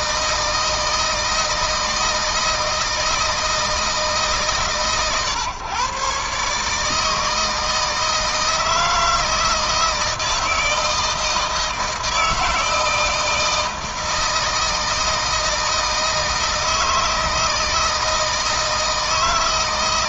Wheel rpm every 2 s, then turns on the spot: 160, 160, 140, 150, 160, 160, 160, 160, 160, 160.
none